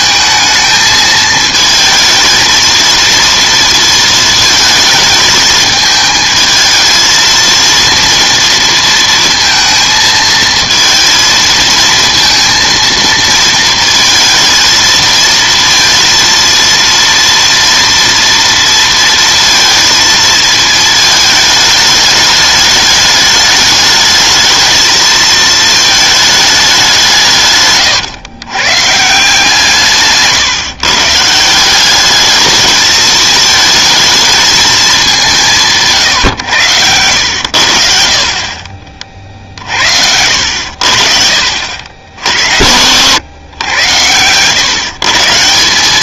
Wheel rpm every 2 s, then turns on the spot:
220, 230, 220, 230, 230, 230, 230, 230, 230, 230, 220, 210, 220, 130, 160, 180, 220, 170, 80, 50, 60, 100, 160.
none